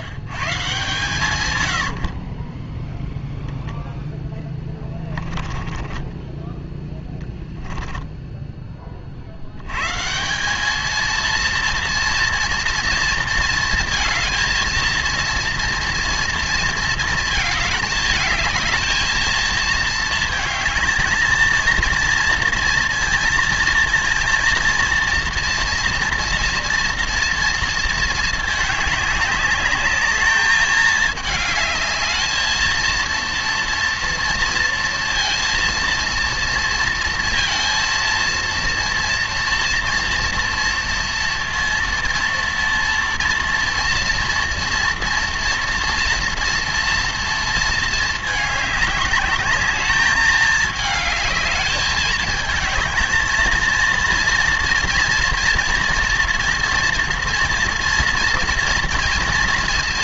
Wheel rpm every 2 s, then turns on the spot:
130, 10, 10, 10, 10, 210, 230, 230, 230, 220, 220, 230, 230, 230, 210, 220, 230, 230, 230, 230, 230, 230, 240, 230, 210, 220, 220, 230, 230, 230.
2-6